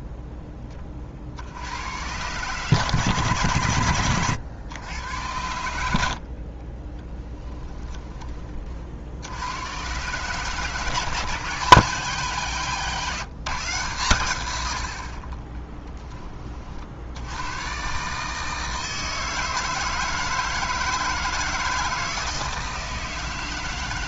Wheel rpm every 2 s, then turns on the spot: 20, 140, 110, 30, 40, 150, 150, 80, 50, 160, 160, 160.
6-8